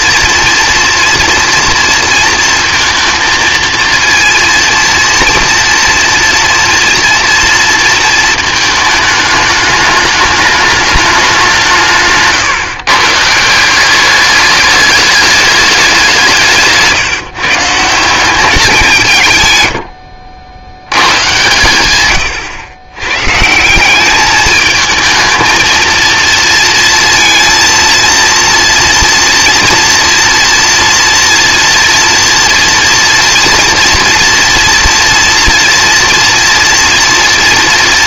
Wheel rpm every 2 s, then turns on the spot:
230, 230, 230, 230, 220, 210, 140, 210, 160, 190, 90, 110, 210, 230, 230, 230, 240, 230, 230.
16-18